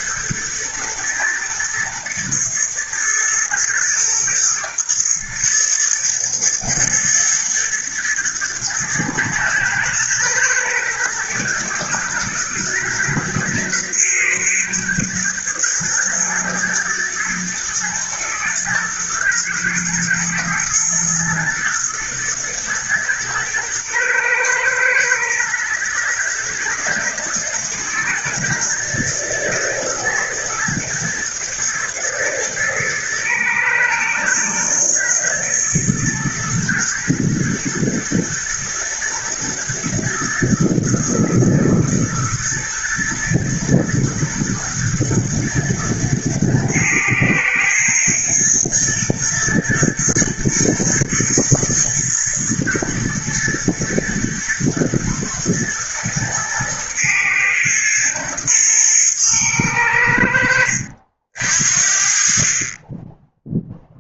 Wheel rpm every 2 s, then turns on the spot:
120, 120, 120, 120, 120, 120, 120, 120, 120, 110, 110, 110, 120, 120, 120, 120, 110, 110, 110, 110, 110, 110, 110, 110, 110, 110, 110, 120, 110, 110, 70, 10.
none